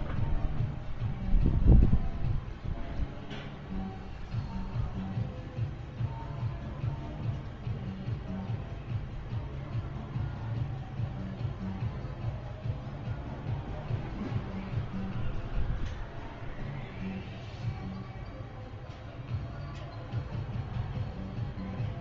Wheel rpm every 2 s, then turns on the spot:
0, 0, 0, 0, 0, 0, 0, 0, 0, 0, 0.
none